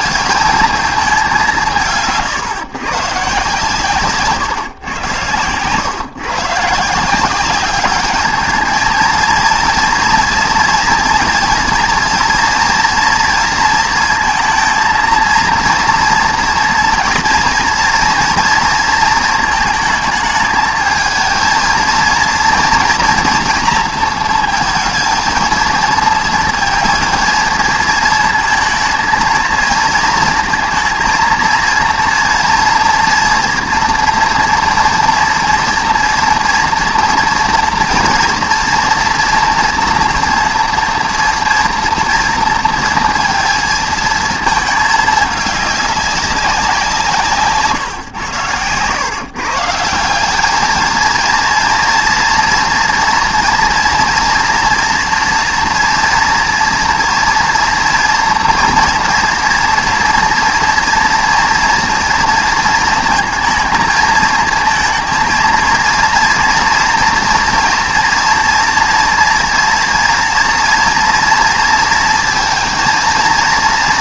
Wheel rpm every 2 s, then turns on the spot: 220, 140, 140, 150, 220, 240, 240, 230, 230, 230, 220, 240, 230, 230, 230, 220, 230, 240, 230, 230, 230, 230, 220, 180, 120, 210, 230, 230, 240, 230, 230, 230, 220, 230, 230, 230, 230.
none